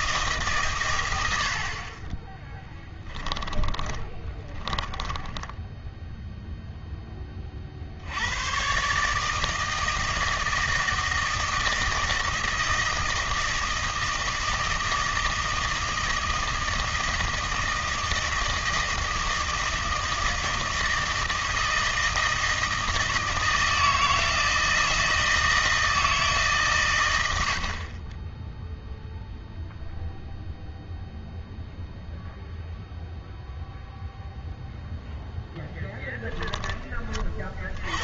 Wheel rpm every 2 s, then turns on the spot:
130, 10, 20, 0, 120, 160, 160, 160, 160, 160, 160, 160, 160, 130, 0, 0, 0, 0, 20.
2-6